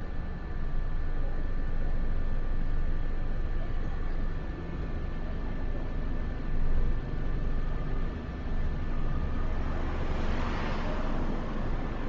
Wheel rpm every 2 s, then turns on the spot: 0, 0, 0, 0, 0, 0.
none